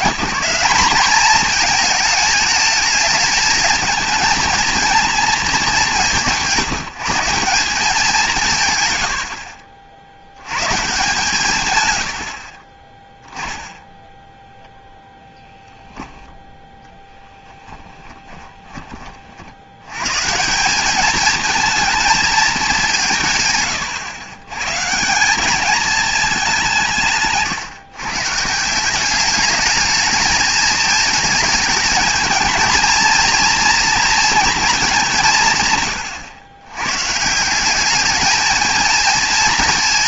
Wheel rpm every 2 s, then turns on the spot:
190, 210, 230, 170, 130, 130, 40, 10, 10, 20, 180, 210, 130, 190, 160, 220, 220, 230, 110, 220.
none